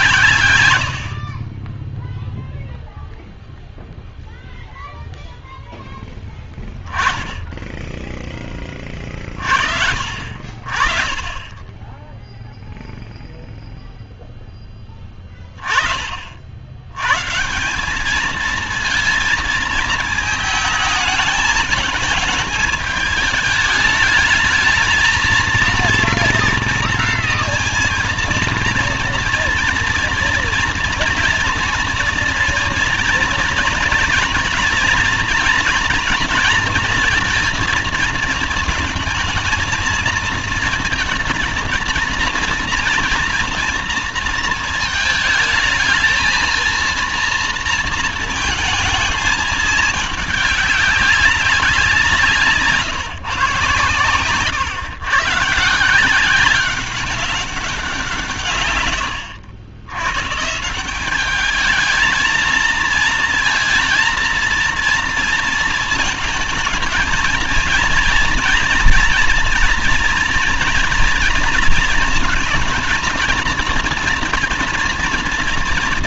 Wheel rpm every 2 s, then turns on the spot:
70, 0, 0, 10, 30, 30, 0, 20, 100, 230, 220, 210, 220, 240, 230, 230, 240, 240, 230, 220, 220, 230, 220, 230, 220, 200, 150, 140, 190, 110, 180, 220, 230, 220, 230, 230, 230, 230.
none